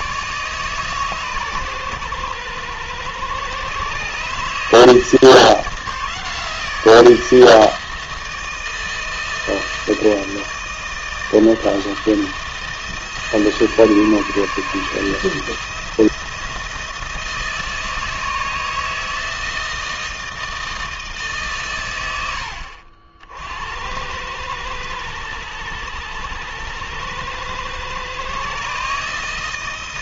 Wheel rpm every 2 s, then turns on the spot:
140, 110, 160, 160, 160, 160, 160, 160, 160, 160, 150, 60, 100, 110, 150.
none